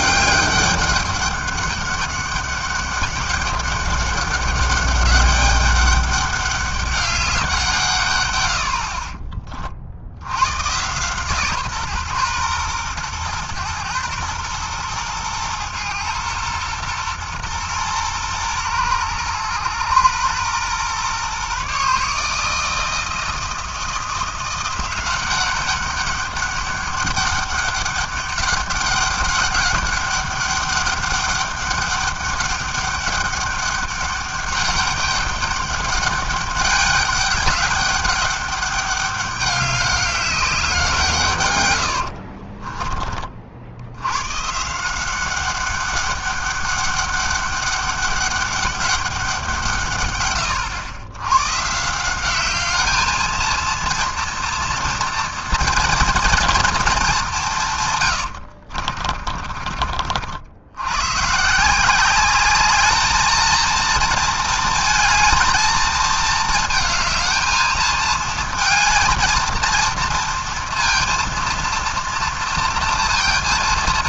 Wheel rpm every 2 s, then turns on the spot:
200, 200, 200, 200, 150, 50, 130, 120, 120, 120, 120, 140, 170, 200, 200, 200, 200, 200, 200, 200, 200, 90, 90, 200, 200, 140, 160, 230, 230, 130, 50, 170, 230, 230, 220, 230, 230.
42-44